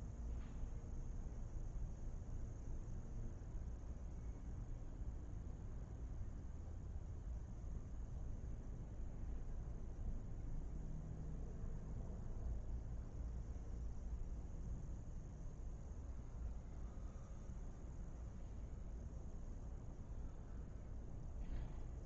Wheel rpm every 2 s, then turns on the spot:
0, 0, 0, 0, 0, 0, 0, 0, 0, 0, 0.
none